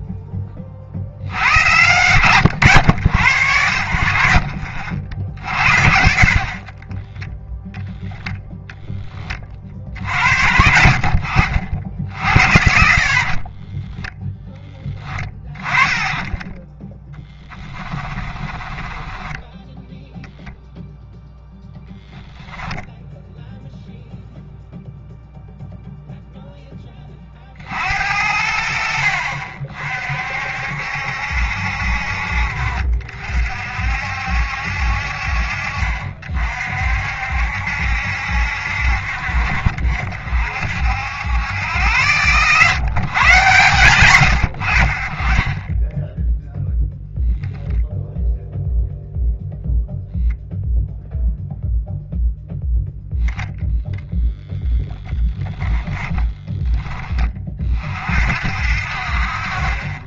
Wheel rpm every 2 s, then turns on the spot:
40, 90, 50, 30, 10, 60, 60, 10, 10, 20, 0, 0, 0, 10, 60, 70, 50, 70, 60, 60, 70, 140, 70, 0, 0, 0, 0, 10, 10, 50.
12-14 18-20 54-56